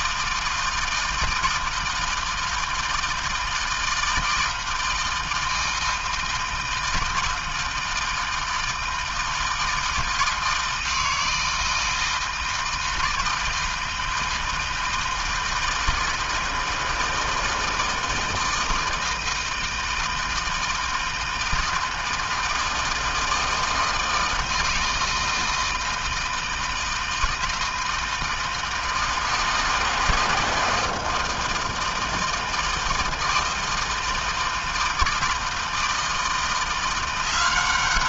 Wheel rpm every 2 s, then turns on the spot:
160, 160, 160, 160, 160, 160, 160, 160, 160, 160, 160, 160, 160, 160, 160, 160, 160, 160, 180.
none